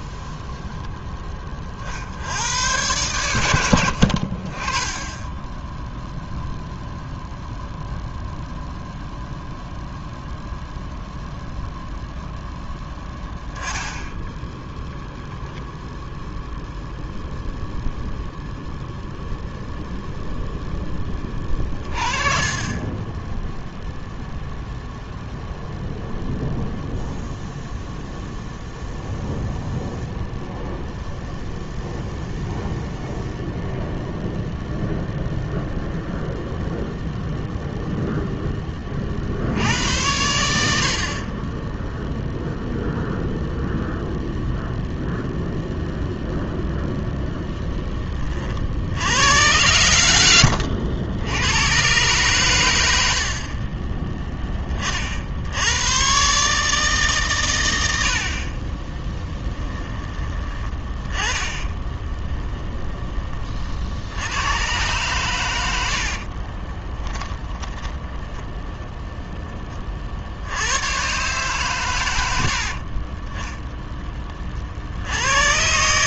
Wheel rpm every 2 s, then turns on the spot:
10, 110, 20, 0, 0, 0, 0, 0, 0, 0, 10, 20, 0, 0, 0, 0, 0, 0, 0, 30, 50, 0, 0, 0, 60, 90, 110, 20, 150, 30, 20, 0, 110, 30, 10, 90, 70, 50.
66-68